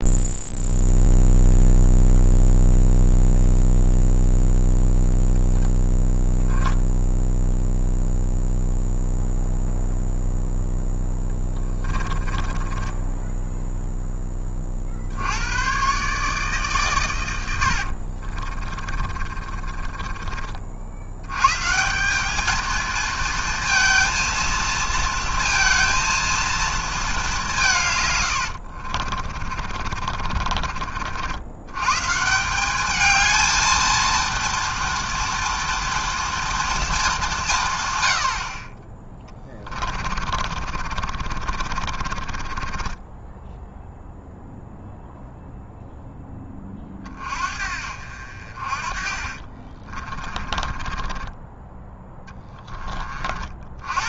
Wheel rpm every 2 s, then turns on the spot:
0, 0, 0, 0, 0, 0, 20, 50, 140, 30, 60, 220, 230, 220, 60, 40, 200, 230, 230, 30, 50, 20, 0, 30, 50, 30, 20.
12-14 18-20 28-32 40-44 48-52